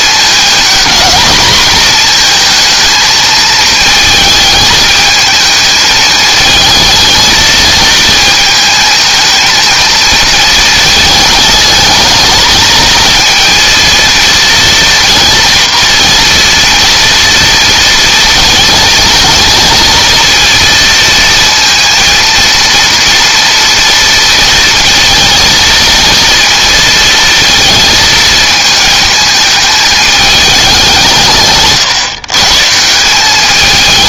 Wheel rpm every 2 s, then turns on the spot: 220, 230, 220, 220, 220, 220, 220, 240, 230, 220, 230, 230, 230, 230, 220, 190, 150.
none